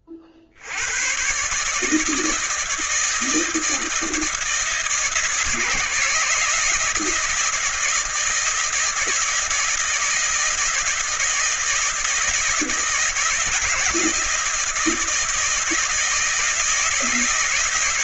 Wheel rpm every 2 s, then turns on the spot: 80, 160, 160, 160, 160, 160, 160, 160, 160.
none